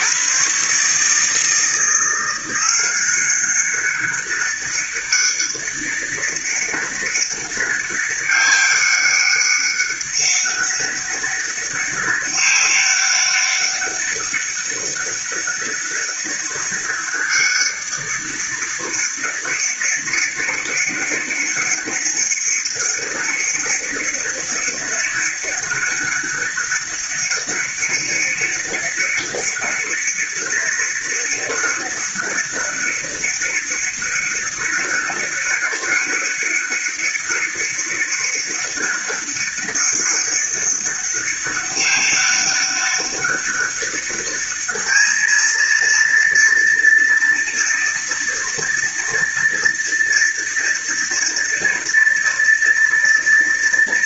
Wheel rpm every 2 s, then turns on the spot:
140, 180, 200, 200, 200, 200, 200, 200, 200, 200, 200, 200, 200, 200, 200, 200, 200, 200, 200, 200, 200, 200, 210, 230, 230, 230, 230.
none